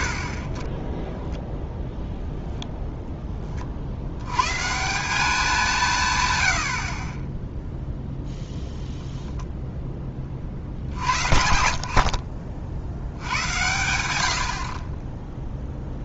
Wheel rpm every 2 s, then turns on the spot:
10, 0, 150, 50, 0, 70, 70, 50.
none